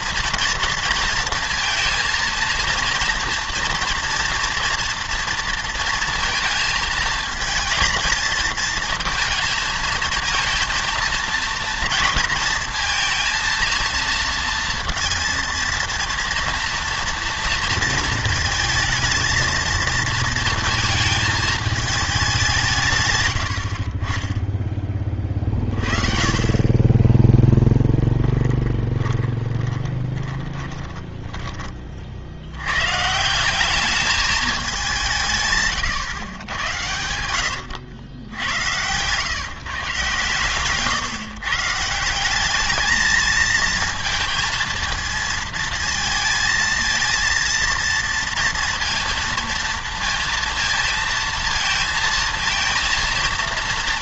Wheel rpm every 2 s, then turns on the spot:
230, 230, 240, 230, 230, 230, 230, 230, 240, 220, 230, 170, 10, 20, 10, 20, 100, 200, 100, 90, 130, 210, 230, 230, 230, 230, 230.
28-32 38-40